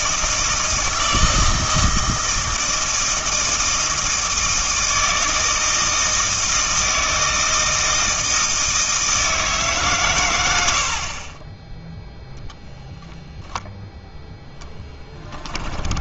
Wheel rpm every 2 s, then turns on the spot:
160, 160, 160, 160, 160, 80, 0, 10.
14-16